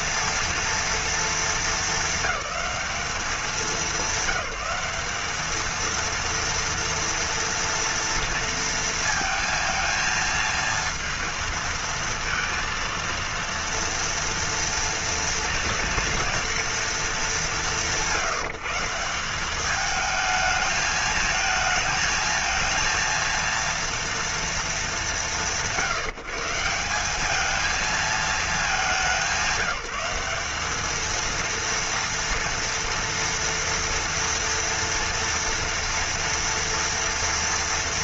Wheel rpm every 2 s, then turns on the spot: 240, 200, 200, 230, 230, 230, 230, 230, 230, 170, 220, 230, 220, 170, 210, 210, 230, 230, 240.
none